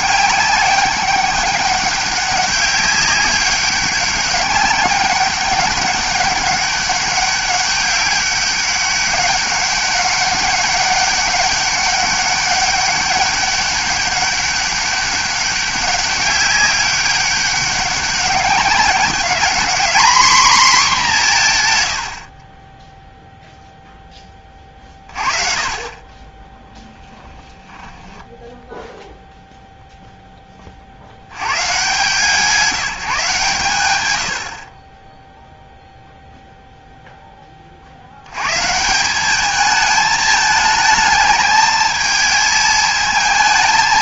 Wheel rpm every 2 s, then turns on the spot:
200, 200, 200, 200, 200, 200, 200, 200, 200, 200, 230, 10, 30, 20, 0, 40, 180, 30, 0, 150, 210, 220.
none